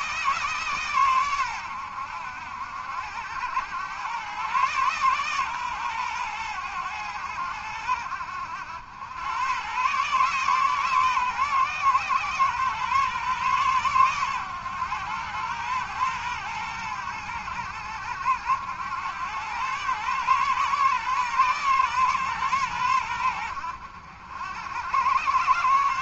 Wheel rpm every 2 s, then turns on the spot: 140, 80, 120, 100, 80, 140, 130, 110, 100, 90, 140, 110, 80.
none